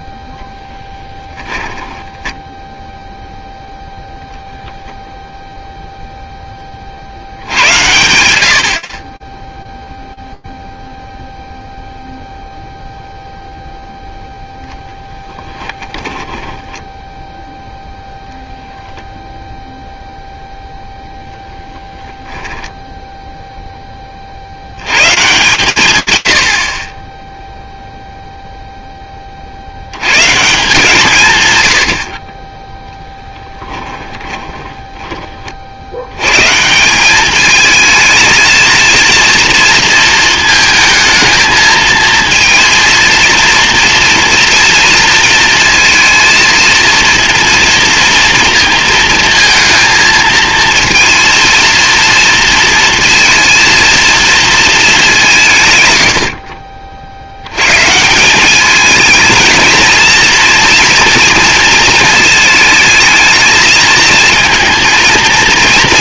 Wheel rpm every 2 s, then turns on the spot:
0, 0, 0, 80, 30, 0, 0, 20, 0, 0, 10, 20, 120, 0, 60, 120, 10, 50, 210, 230, 220, 230, 230, 230, 220, 230, 230, 140, 110, 230, 230, 220, 230.
14-16 32-34